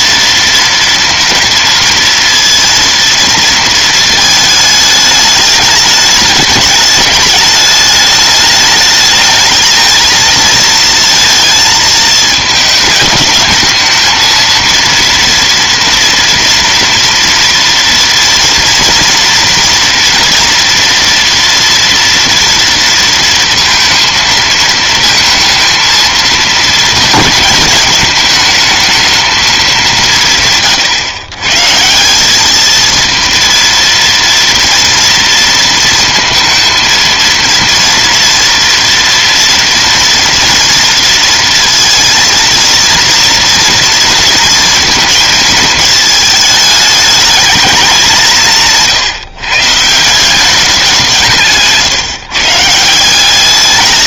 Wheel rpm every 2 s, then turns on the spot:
230, 230, 220, 210, 210, 220, 220, 220, 230, 230, 230, 230, 230, 230, 220, 160, 200, 230, 230, 240, 230, 230, 230, 220, 180, 190, 150.
none